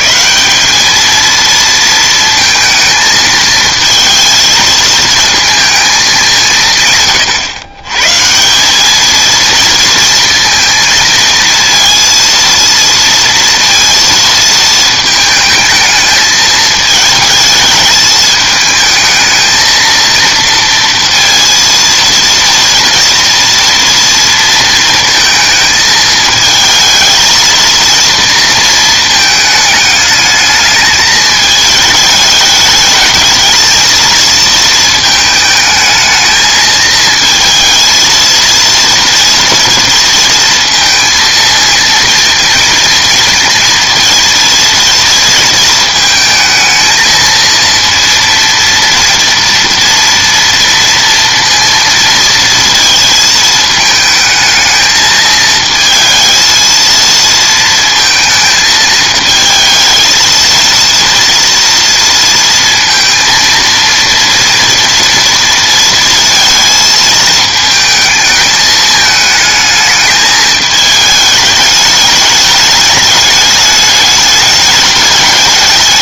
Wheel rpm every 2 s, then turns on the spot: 200, 220, 220, 150, 200, 230, 230, 220, 220, 220, 230, 240, 230, 220, 230, 220, 210, 220, 220, 230, 230, 230, 230, 220, 230, 230, 230, 220, 220, 220, 230, 230, 240, 220, 220, 220, 210, 210.
none